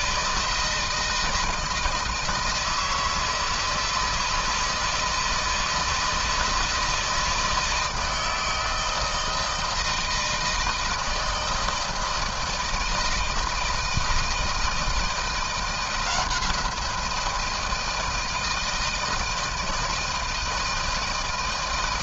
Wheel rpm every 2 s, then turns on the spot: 160, 160, 160, 160, 160, 160, 160, 160, 170, 160, 160.
none